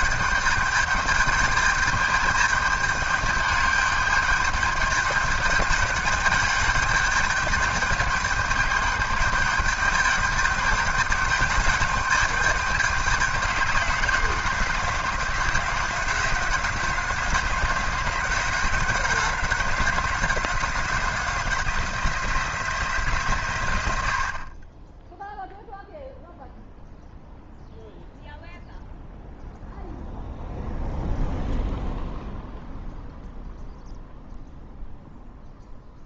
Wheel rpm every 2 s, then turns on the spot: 210, 210, 210, 210, 210, 210, 200, 190, 190, 190, 190, 170, 20, 0, 0, 0, 0, 0.
none